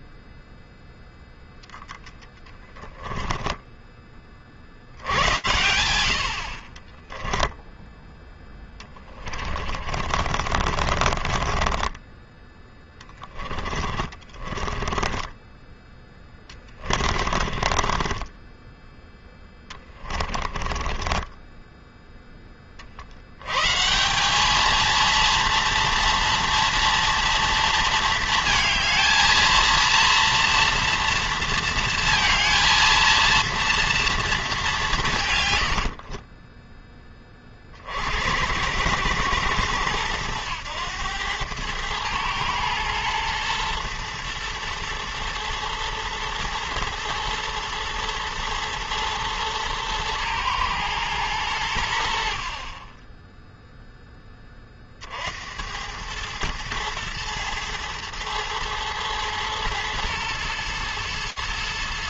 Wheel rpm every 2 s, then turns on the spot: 0, 20, 30, 60, 20, 50, 20, 20, 20, 10, 20, 40, 210, 240, 220, 230, 230, 190, 10, 90, 100, 110, 110, 110, 120, 110, 40, 20, 110, 110, 120.
2-4 6-8 10-18 20-22 36-38